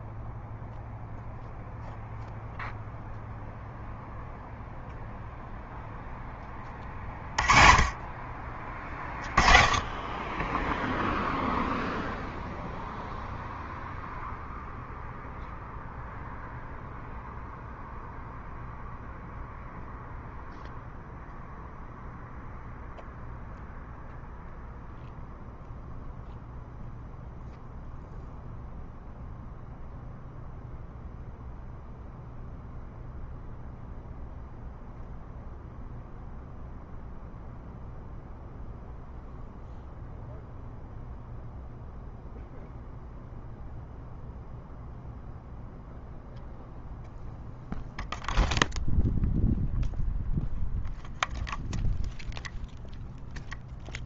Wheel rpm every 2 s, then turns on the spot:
0, 0, 0, 10, 30, 20, 0, 0, 0, 0, 0, 0, 0, 0, 0, 0, 0, 0, 0, 0, 0, 0, 0, 0, 0, 0, 0.
none